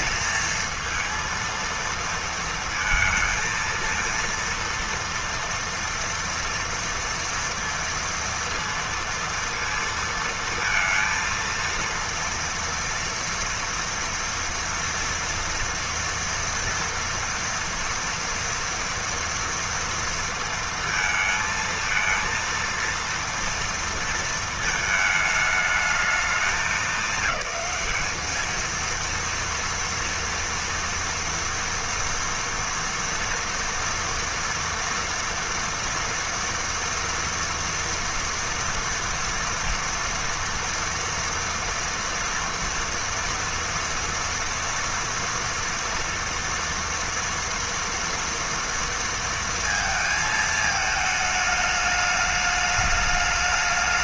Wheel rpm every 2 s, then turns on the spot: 230, 230, 230, 240, 230, 230, 230, 230, 230, 230, 220, 230, 220, 210, 230, 230, 230, 230, 230, 230, 230, 230, 240, 230, 230, 210, 210.
none